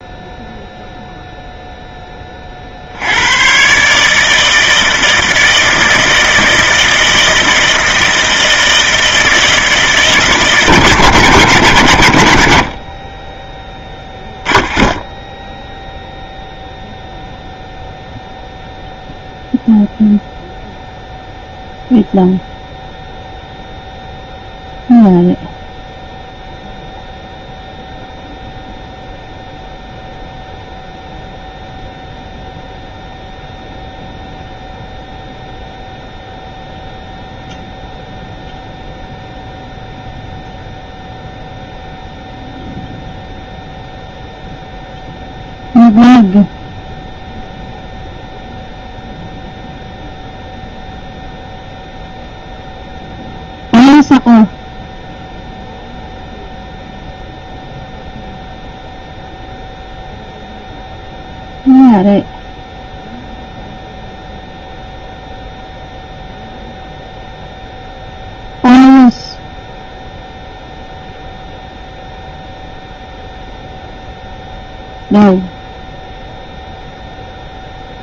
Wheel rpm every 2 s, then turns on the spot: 0, 60, 160, 160, 160, 150, 70, 10, 0, 0, 0, 0, 0, 0, 0, 0, 0, 0, 0, 0, 0, 0, 0, 0, 0, 0, 0, 0, 0, 0, 0, 0, 0, 0, 0, 0, 0, 0, 0.
none